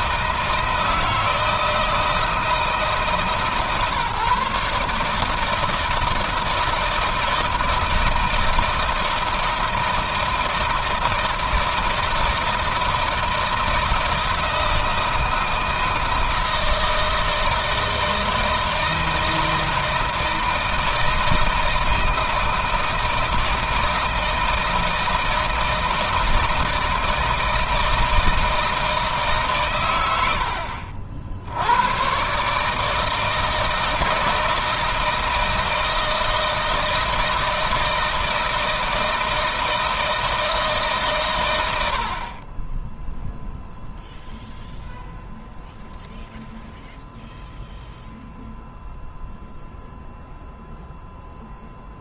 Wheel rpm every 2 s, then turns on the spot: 160, 160, 140, 160, 160, 160, 160, 160, 160, 160, 160, 160, 160, 160, 160, 70, 140, 160, 160, 160, 160, 40, 0, 0, 0, 0.
none